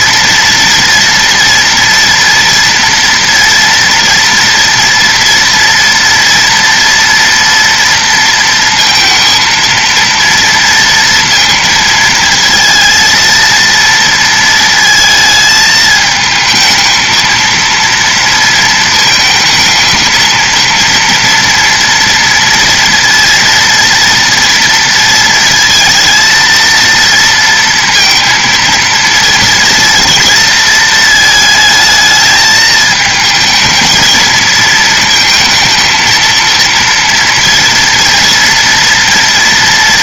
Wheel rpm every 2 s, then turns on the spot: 230, 230, 230, 230, 230, 230, 230, 230, 220, 220, 230, 230, 230, 230, 230, 220, 220, 220, 230, 230.
none